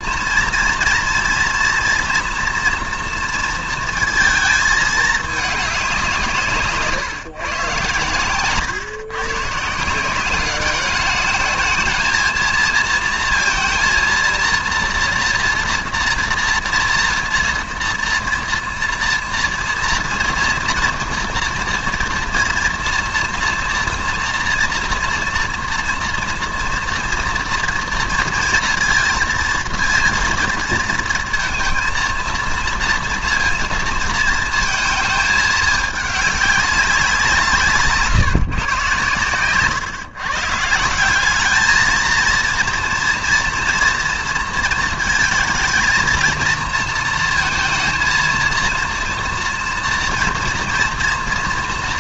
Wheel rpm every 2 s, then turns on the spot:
230, 230, 220, 150, 130, 200, 230, 230, 230, 240, 230, 230, 240, 230, 230, 230, 230, 220, 200, 130, 160, 230, 230, 230, 230, 230.
none